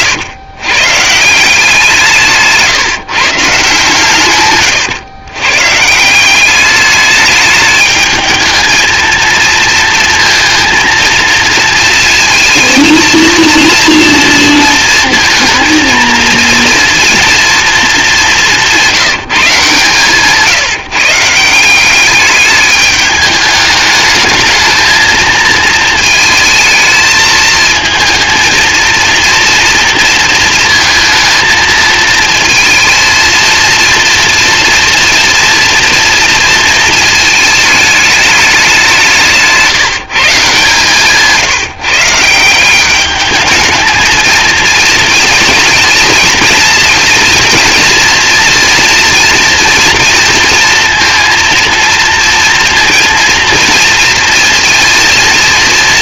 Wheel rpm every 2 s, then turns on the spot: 140, 140, 120, 210, 220, 230, 230, 230, 230, 190, 160, 210, 220, 220, 230, 230, 220, 230, 230, 190, 150, 190, 230, 230, 230, 230, 230, 230.
none